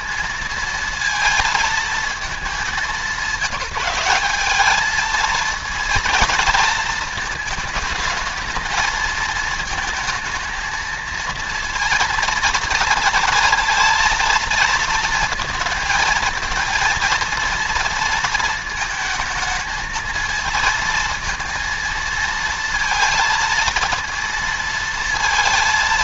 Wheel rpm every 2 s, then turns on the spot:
230, 200, 220, 220, 220, 230, 230, 230, 220, 220, 230, 230, 230.
none